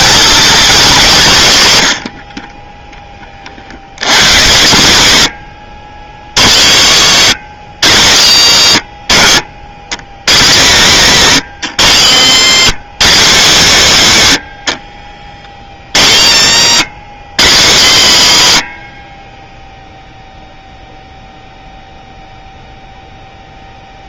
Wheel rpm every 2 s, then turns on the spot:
200, 20, 140, 80, 110, 100, 150, 90, 120, 110, 0, 0.
none